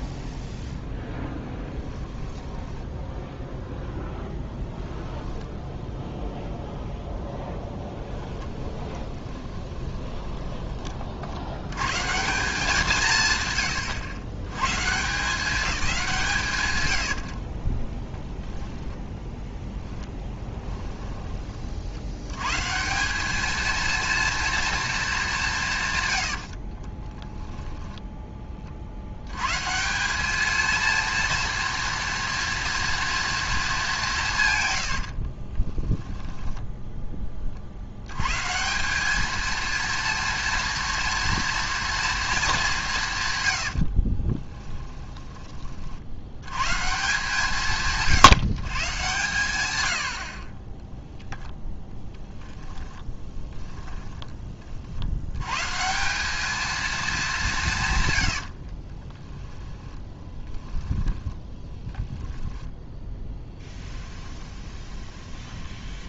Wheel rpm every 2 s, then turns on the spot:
0, 10, 10, 0, 20, 40, 160, 160, 90, 10, 20, 180, 220, 30, 60, 230, 230, 80, 10, 190, 230, 170, 20, 140, 140, 10, 10, 70, 220, 30, 10, 10, 10.
2-6 8-10 16-22 26-28 34-36 44-46 52-54 58-66